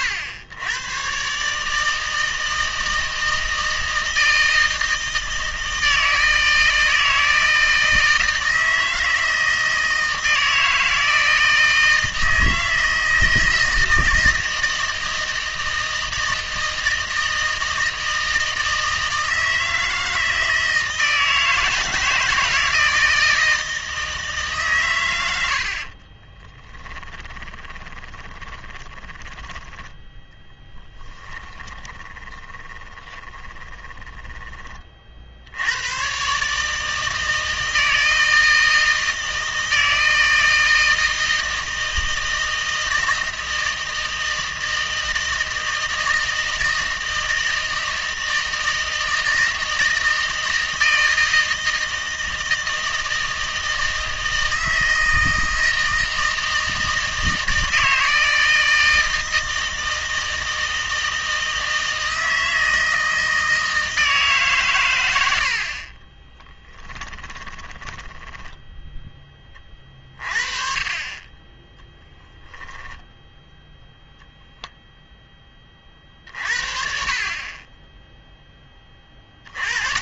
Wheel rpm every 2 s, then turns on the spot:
110, 160, 160, 160, 160, 160, 160, 160, 160, 160, 160, 160, 130, 10, 20, 10, 10, 30, 160, 160, 160, 160, 160, 160, 160, 160, 160, 160, 160, 160, 160, 160, 120, 10, 10, 30, 0, 0, 50, 20.
26-34 66-68